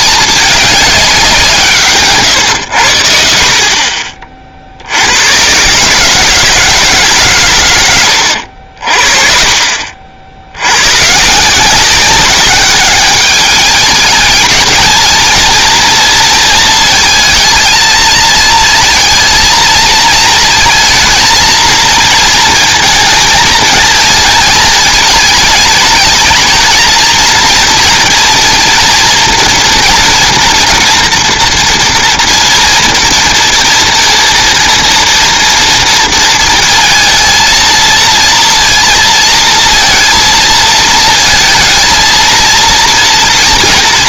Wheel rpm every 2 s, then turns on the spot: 200, 110, 50, 150, 60, 100, 200, 220, 230, 230, 220, 220, 230, 220, 230, 230, 230, 230, 220, 230, 230, 230.
8-10